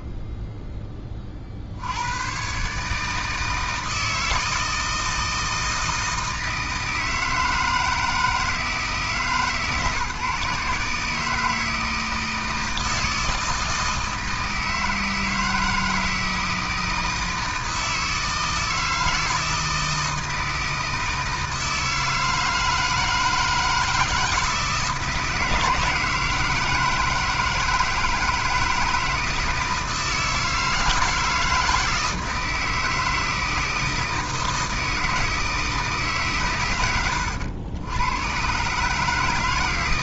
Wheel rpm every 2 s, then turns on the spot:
10, 140, 160, 160, 160, 150, 160, 160, 160, 160, 160, 160, 160, 160, 160, 160, 160, 160, 110, 140.
none